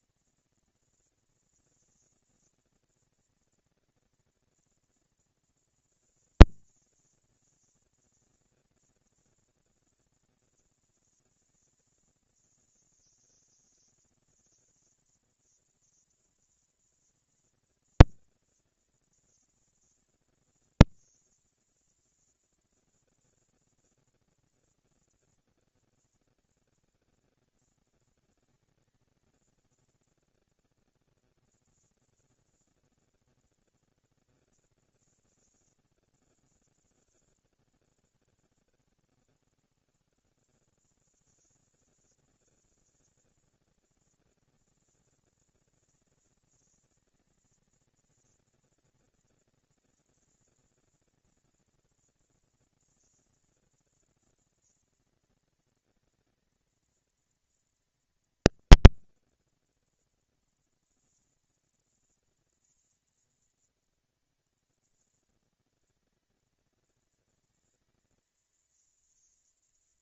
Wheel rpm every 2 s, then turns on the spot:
230, 230, 230, 230, 230, 230, 230, 230, 240, 220, 240, 230, 230, 230, 230, 230, 230, 230, 190, 140, 90, 190, 230, 230, 230, 230, 230, 230, 230, 230, 230, 220, 220, 230, 220.
none